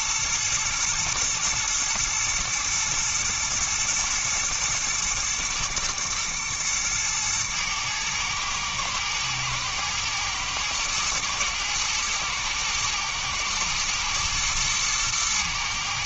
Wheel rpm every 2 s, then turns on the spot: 120, 110, 110, 110, 110, 110, 110, 110.
none